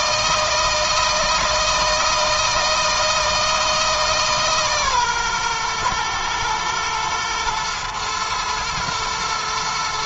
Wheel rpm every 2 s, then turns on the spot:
160, 160, 150, 110, 110.
none